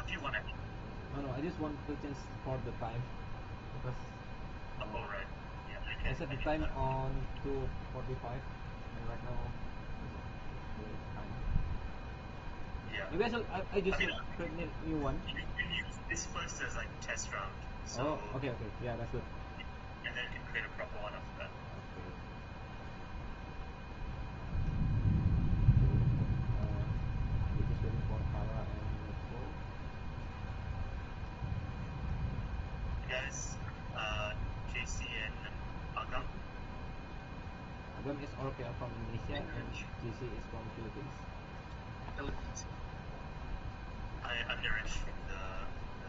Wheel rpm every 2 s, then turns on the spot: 0, 0, 0, 0, 0, 0, 0, 0, 0, 0, 0, 0, 0, 0, 0, 0, 0, 0, 0, 0, 0, 0, 0.
none